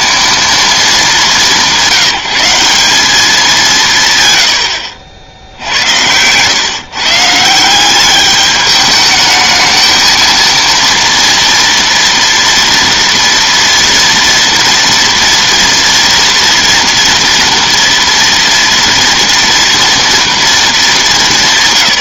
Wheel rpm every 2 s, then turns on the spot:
200, 200, 80, 140, 210, 230, 230, 230, 230, 230, 220.
none